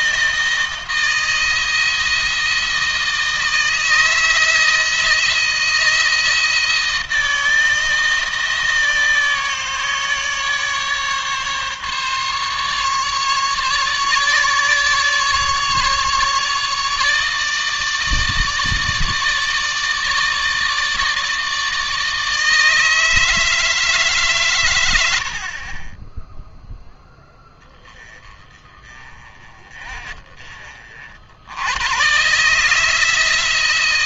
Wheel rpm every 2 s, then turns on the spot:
160, 160, 160, 160, 160, 150, 140, 140, 150, 160, 160, 160, 110, 10, 30, 50, 150.
none